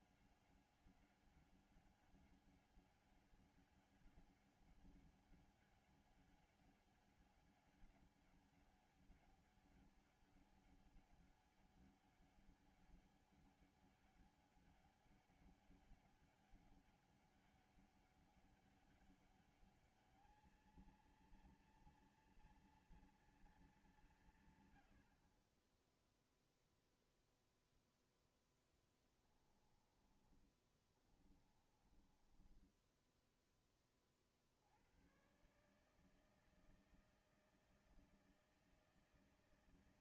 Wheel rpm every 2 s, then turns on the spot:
190, 190, 190, 190, 200, 200, 200, 200, 200, 200, 220, 230, 120, 0, 10, 20, 20, 60, 160, 160.
28-34